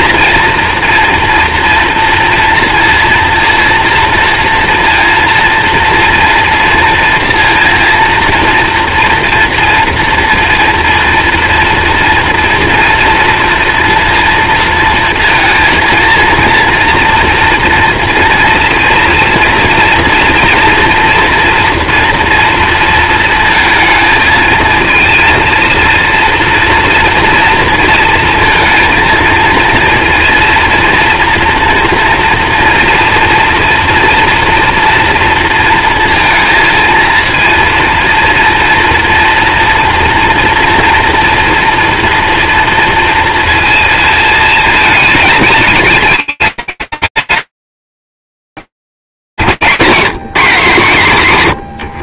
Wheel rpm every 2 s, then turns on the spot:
240, 230, 230, 230, 230, 230, 230, 230, 240, 240, 240, 230, 220, 230, 220, 230, 230, 230, 220, 230, 230, 240, 220, 210, 160, 160.
none